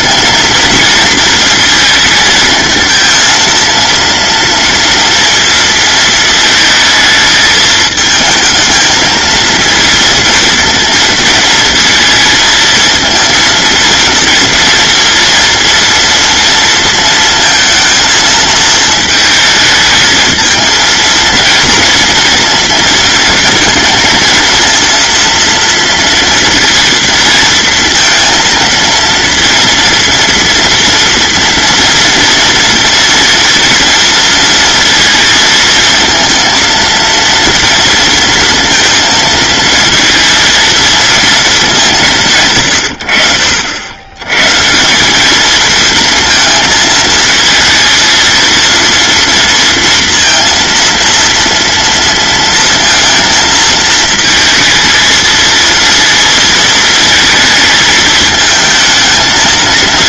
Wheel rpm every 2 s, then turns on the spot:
230, 220, 230, 220, 220, 230, 220, 230, 230, 220, 230, 230, 230, 230, 230, 230, 230, 230, 230, 230, 230, 90, 180, 220, 230, 230, 230, 220, 220, 220.
none